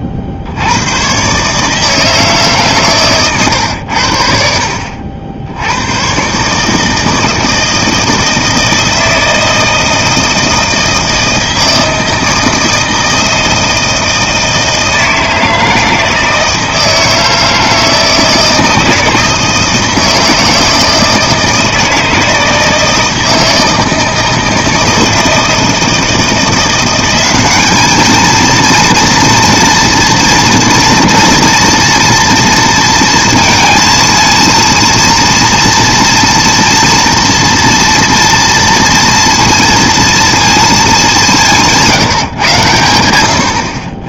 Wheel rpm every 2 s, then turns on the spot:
80, 140, 70, 150, 160, 160, 160, 160, 160, 160, 160, 160, 160, 170, 230, 230, 230, 230, 230, 230, 220, 110.
none